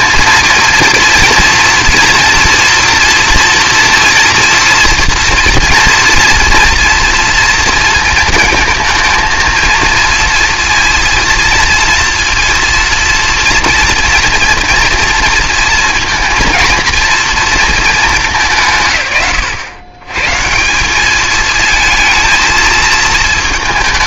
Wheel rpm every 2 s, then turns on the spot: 230, 230, 230, 230, 230, 230, 230, 230, 230, 200, 160, 220.
none